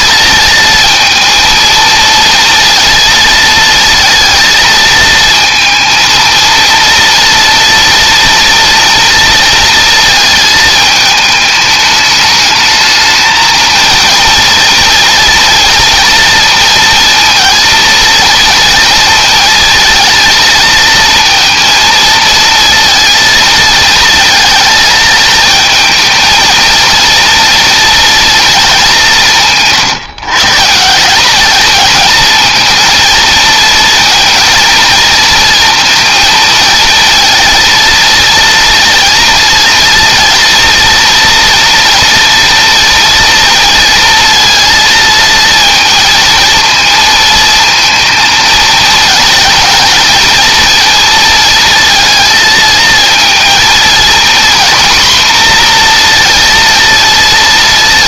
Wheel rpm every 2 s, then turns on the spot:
220, 230, 220, 230, 230, 220, 220, 230, 230, 230, 220, 230, 220, 230, 180, 180, 230, 230, 230, 230, 230, 230, 230, 220, 220, 230, 220, 240, 230.
none